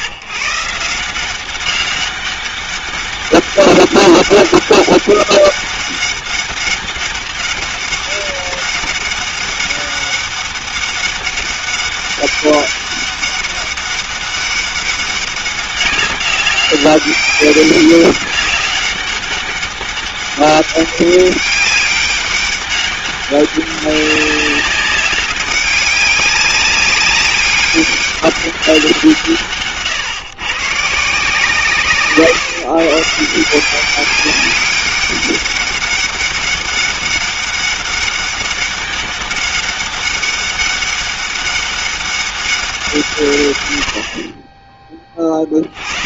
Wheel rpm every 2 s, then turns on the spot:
140, 200, 200, 200, 200, 200, 200, 190, 200, 200, 200, 200, 200, 200, 190, 130, 150, 200, 200, 200, 200, 180, 20.
none